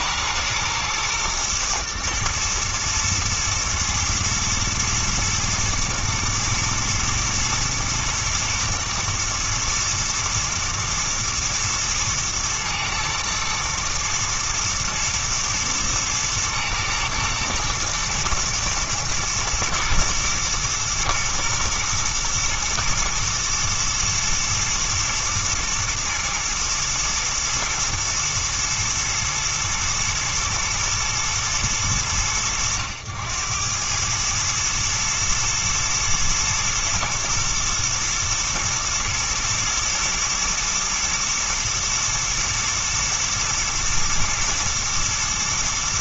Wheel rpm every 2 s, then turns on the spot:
110, 120, 110, 120, 110, 110, 110, 110, 110, 110, 110, 110, 110, 120, 110, 110, 90, 110, 110, 110, 120, 110, 120.
none